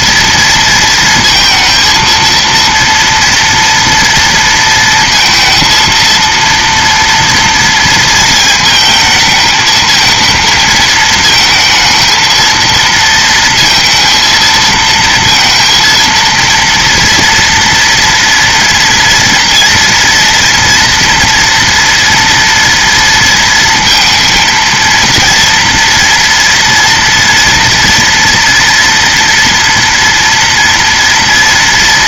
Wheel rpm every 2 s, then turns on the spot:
230, 230, 230, 230, 220, 220, 230, 230, 230, 240, 240, 230, 230, 230, 230, 230.
none